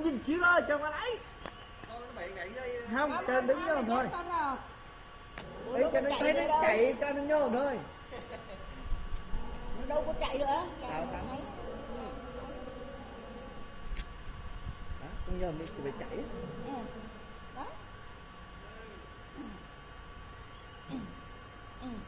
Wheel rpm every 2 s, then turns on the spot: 0, 0, 0, 0, 0, 0, 0, 0, 0, 0, 0.
none